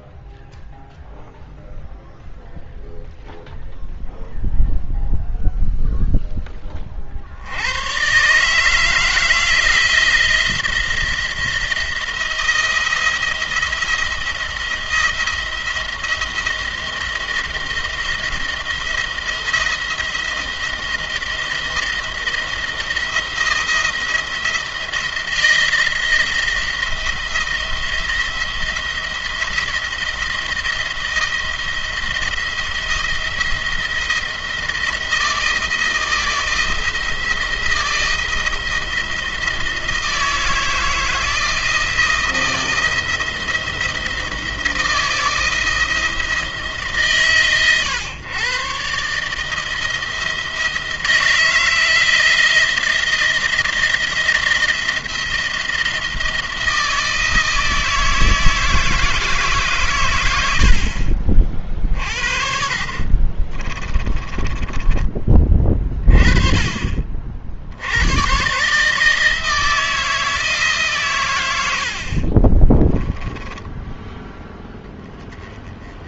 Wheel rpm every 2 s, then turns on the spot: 0, 0, 0, 20, 150, 170, 170, 170, 170, 170, 170, 170, 170, 170, 170, 170, 170, 160, 170, 170, 160, 170, 170, 160, 130, 160, 170, 170, 170, 160, 70, 50, 20, 30, 130, 150, 20, 10.
62-66 72-74